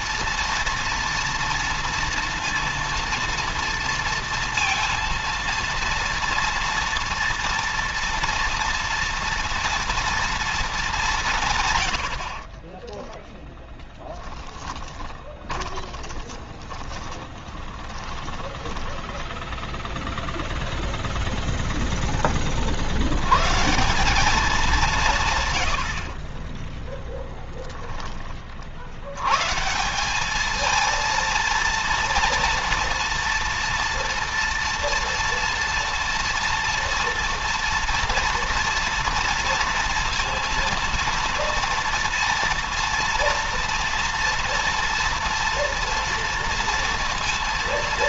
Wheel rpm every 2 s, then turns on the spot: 230, 230, 230, 230, 240, 230, 60, 10, 20, 10, 0, 20, 200, 40, 30, 190, 230, 230, 230, 230, 230, 230, 230, 230.
12-18 26-28